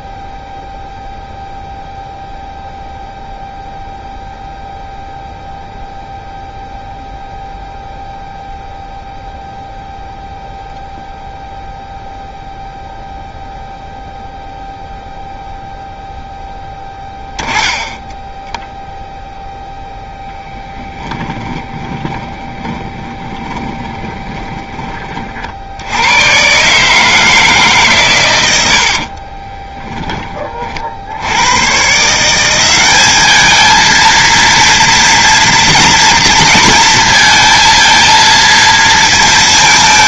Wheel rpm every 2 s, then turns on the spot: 0, 0, 0, 0, 0, 0, 0, 0, 10, 0, 10, 20, 20, 140, 90, 40, 190, 230, 230, 230.
16-18 20-24